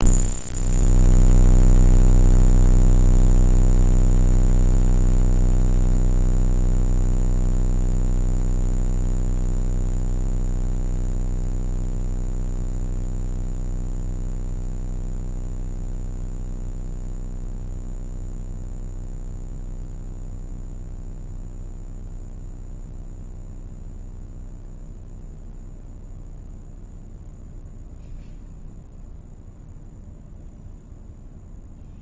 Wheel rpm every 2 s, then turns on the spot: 0, 0, 0, 0, 0, 0, 0, 0, 0, 0, 0, 0, 0, 0, 0, 0.
none